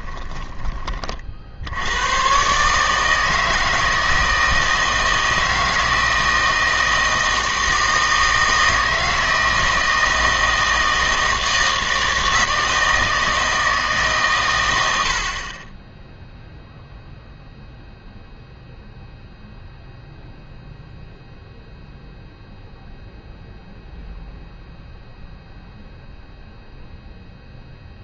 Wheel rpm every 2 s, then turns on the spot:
30, 150, 160, 160, 160, 160, 160, 100, 0, 0, 0, 0, 0, 0.
none